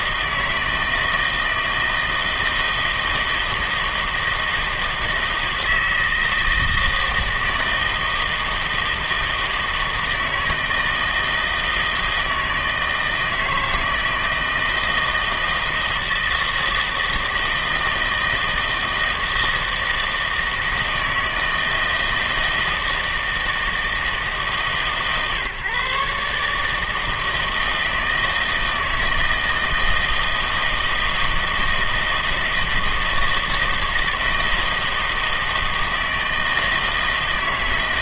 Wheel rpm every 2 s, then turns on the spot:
160, 160, 160, 160, 160, 160, 160, 160, 160, 160, 160, 160, 140, 150, 160, 160, 160, 160, 160.
none